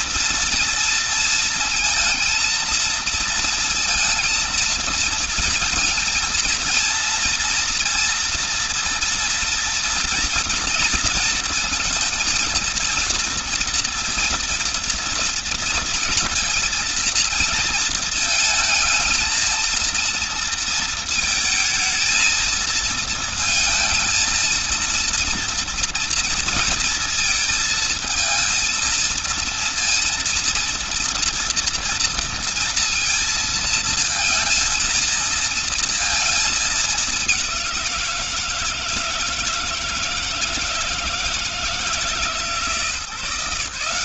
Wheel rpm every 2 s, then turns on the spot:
230, 230, 230, 230, 230, 230, 230, 230, 230, 220, 230, 220, 230, 230, 230, 230, 230, 230, 220, 170, 160, 160.
none